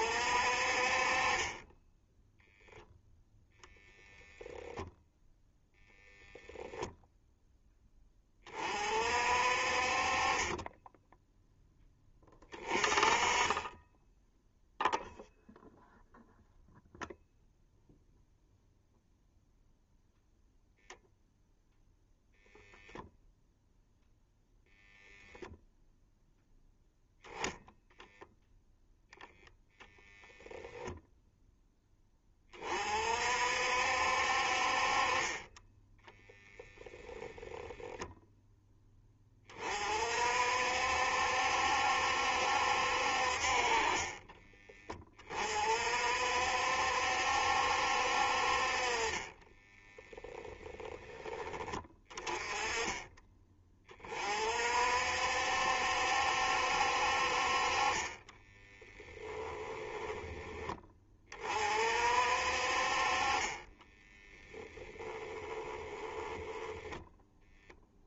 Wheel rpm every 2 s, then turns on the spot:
40, 0, 10, 0, 40, 10, 20, 0, 0, 0, 0, 0, 0, 0, 0, 0, 40, 40, 0, 10, 60, 60, 20, 60, 40, 10, 30, 50, 60, 10, 20, 40, 10, 10.
58-60